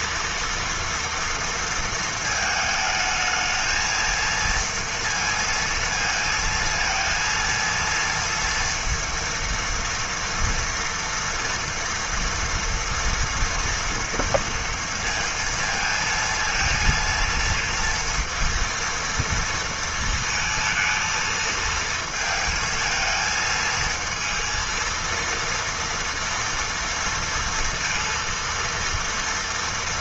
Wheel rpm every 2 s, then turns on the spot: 230, 220, 230, 230, 230, 230, 230, 230, 230, 230, 230, 220, 230, 230, 230.
none